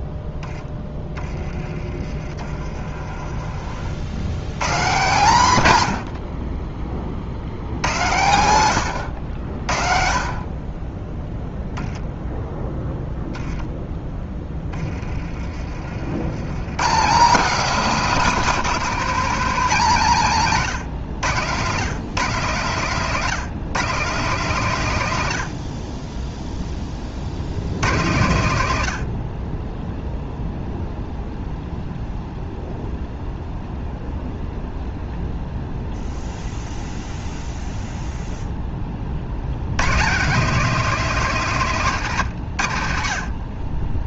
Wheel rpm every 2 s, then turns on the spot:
10, 40, 140, 30, 100, 30, 0, 20, 130, 230, 150, 160, 150, 20, 100, 0, 0, 0, 0, 20, 210, 80.
2-4 14-16